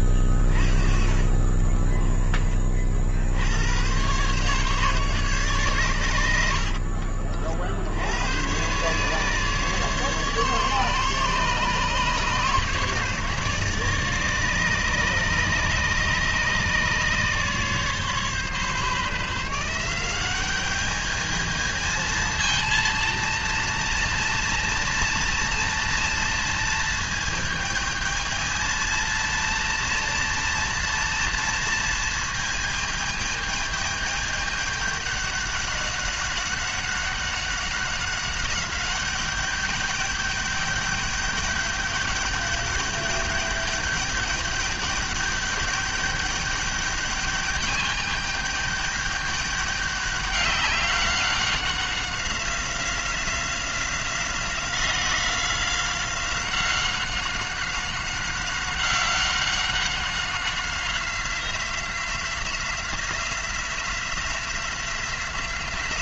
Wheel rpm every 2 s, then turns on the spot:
30, 20, 130, 80, 110, 140, 140, 150, 150, 140, 200, 230, 230, 230, 220, 230, 220, 210, 200, 190, 210, 210, 210, 200, 210, 200, 190, 180, 190, 190, 190, 180, 180.
none